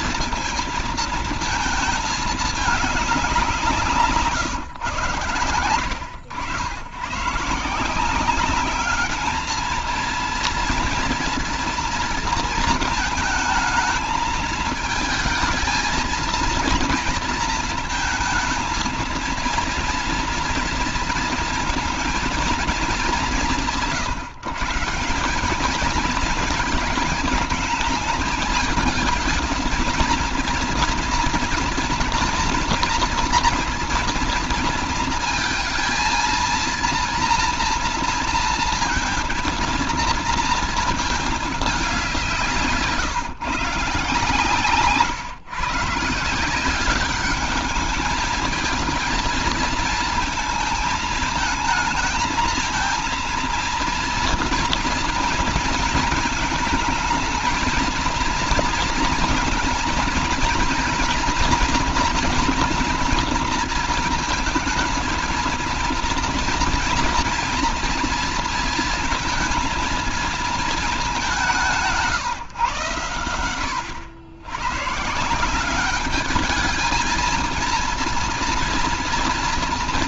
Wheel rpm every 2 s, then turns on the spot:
230, 200, 120, 120, 210, 230, 220, 220, 230, 230, 230, 200, 180, 220, 220, 230, 230, 230, 230, 230, 220, 150, 140, 200, 230, 220, 230, 230, 220, 230, 240, 230, 230, 230, 230, 200, 100, 140, 220, 230.
none